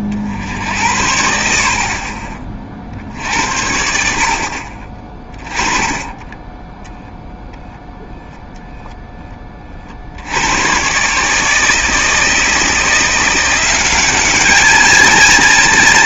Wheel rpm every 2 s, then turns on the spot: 70, 40, 40, 10, 10, 120, 170, 220.
6-8